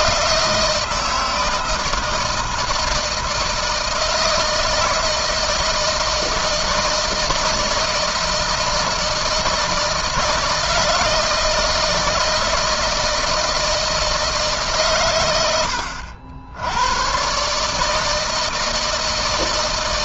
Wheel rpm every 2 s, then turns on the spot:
160, 160, 160, 160, 160, 160, 160, 110, 110, 160.
none